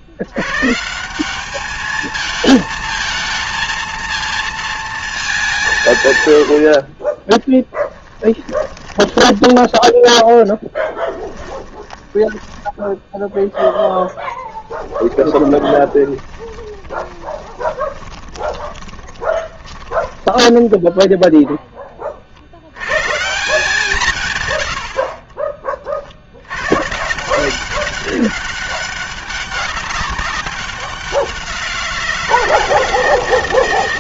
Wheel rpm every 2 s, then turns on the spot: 110, 220, 230, 80, 20, 10, 10, 10, 20, 20, 10, 70, 110, 110, 200, 190, 170.
6-22 24-26